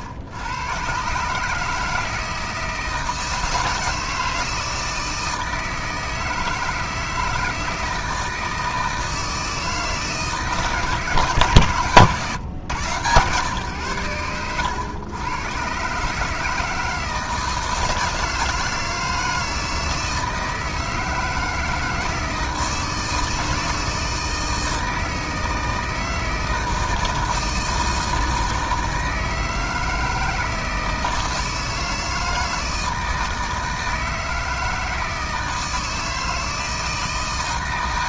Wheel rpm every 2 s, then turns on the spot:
120, 160, 160, 160, 160, 160, 130, 110, 160, 160, 160, 160, 160, 160, 160, 160, 160, 160, 160.
none